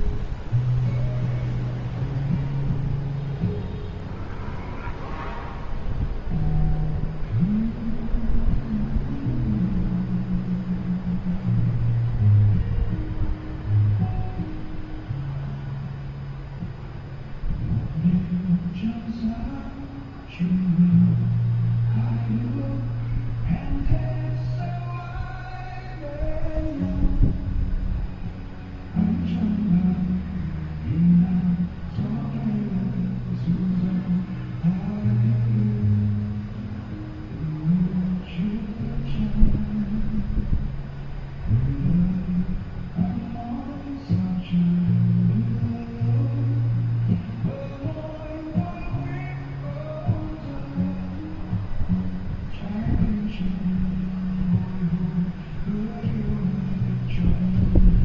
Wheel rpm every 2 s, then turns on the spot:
0, 0, 0, 0, 0, 0, 0, 0, 0, 0, 0, 0, 0, 0, 0, 0, 0, 0, 0, 0, 0, 0, 0, 0, 0, 0, 0, 0, 0.
none